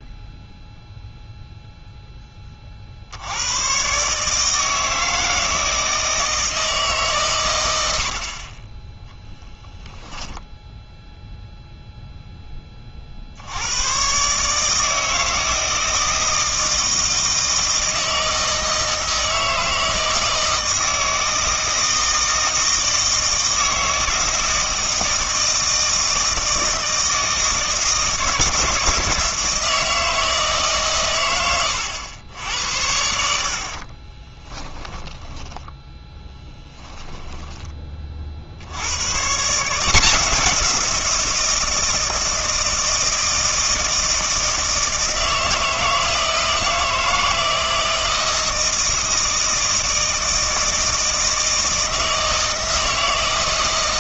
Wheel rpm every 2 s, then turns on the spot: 0, 40, 160, 150, 20, 0, 30, 150, 160, 160, 160, 160, 160, 160, 160, 150, 80, 10, 10, 70, 170, 160, 160, 160, 160, 160, 160.
34-38